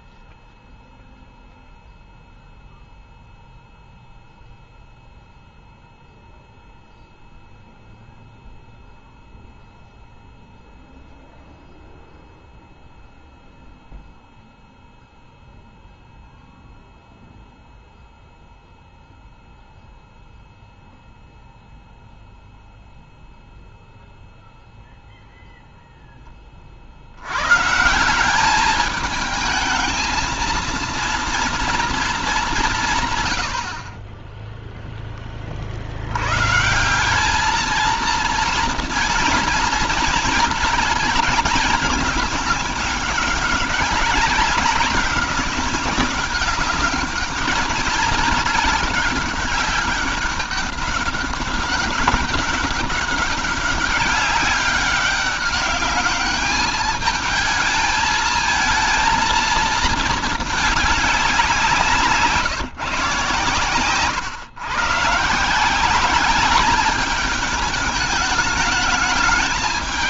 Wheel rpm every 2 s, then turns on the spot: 0, 0, 0, 0, 0, 0, 0, 0, 0, 0, 0, 0, 0, 30, 200, 230, 190, 10, 140, 230, 220, 210, 190, 200, 210, 190, 200, 200, 210, 220, 210, 150, 130, 200, 210.
none